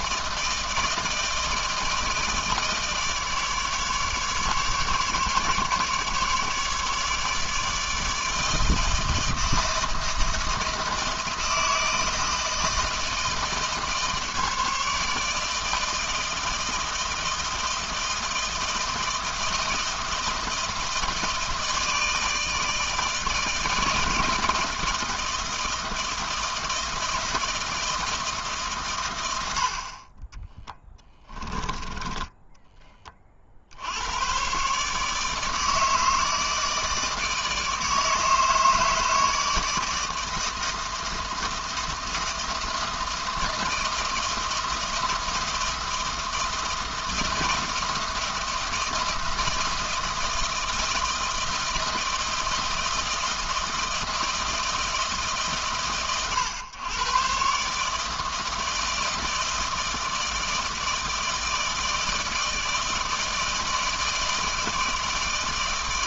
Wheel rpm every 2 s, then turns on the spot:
160, 150, 150, 150, 160, 160, 160, 150, 160, 160, 160, 160, 160, 160, 130, 10, 20, 140, 160, 160, 160, 160, 160, 160, 160, 160, 160, 160, 120, 160, 160, 160, 160.
30-32